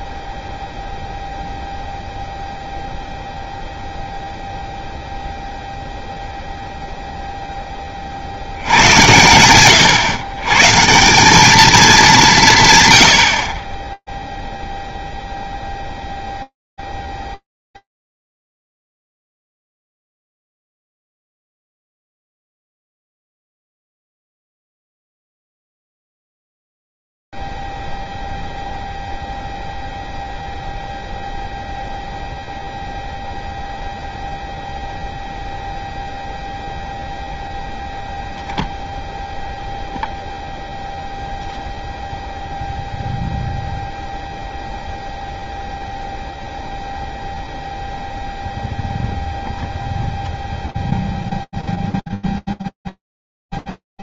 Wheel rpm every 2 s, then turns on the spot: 20, 0, 0, 0, 0, 110, 170, 100, 0, 0, 0, 0, 0, 0, 0, 0, 0, 0, 0, 0, 0, 0, 0, 0, 0, 0, 0.
none